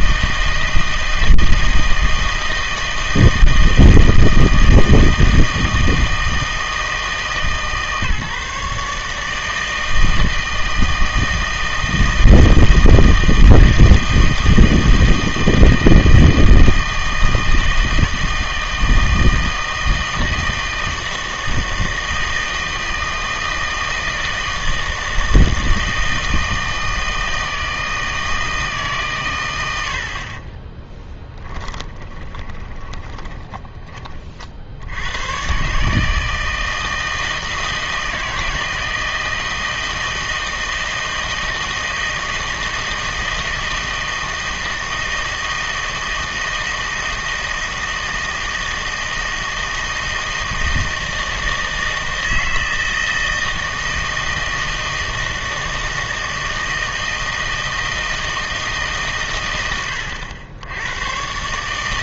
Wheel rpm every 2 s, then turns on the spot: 160, 160, 160, 160, 150, 160, 160, 160, 160, 160, 160, 160, 160, 160, 150, 10, 20, 70, 160, 160, 160, 160, 160, 160, 160, 160, 160, 160, 160, 150, 90.
30-34